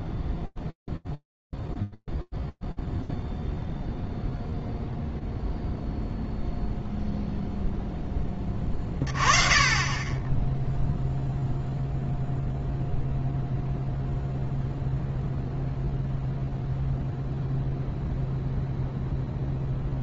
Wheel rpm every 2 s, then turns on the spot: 0, 0, 0, 0, 20, 10, 0, 0, 0, 0.
none